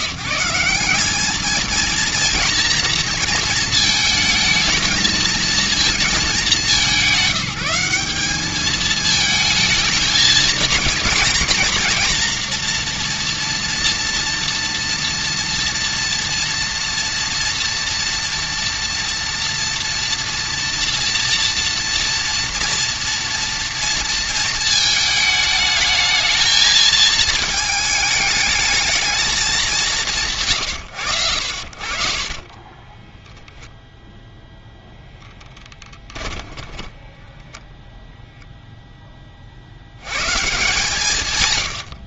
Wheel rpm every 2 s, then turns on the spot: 180, 230, 220, 200, 210, 230, 240, 240, 230, 230, 240, 230, 220, 220, 210, 130, 20, 0, 10, 0, 150.
32-34 36-38